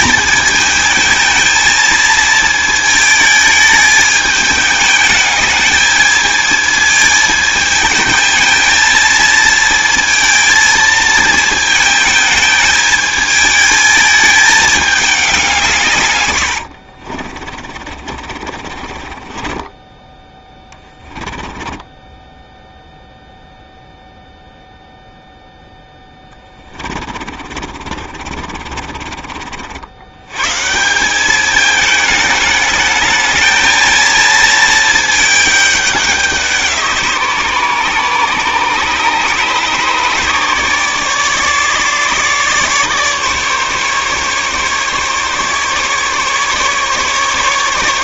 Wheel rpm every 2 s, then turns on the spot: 220, 220, 210, 220, 230, 230, 220, 210, 70, 40, 20, 0, 0, 30, 40, 140, 210, 220, 170, 150, 150, 150, 140, 140.
16-22 26-30